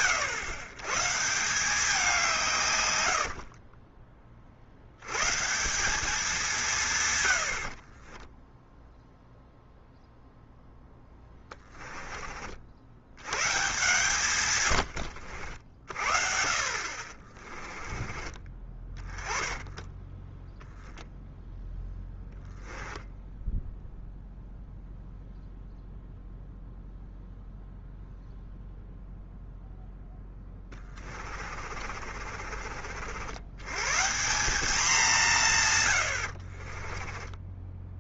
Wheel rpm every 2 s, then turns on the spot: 110, 110, 70, 170, 0, 0, 70, 100, 40, 20, 0, 0, 0, 0, 0, 20, 50, 190, 30.
2-4 14-20 30-32 36-38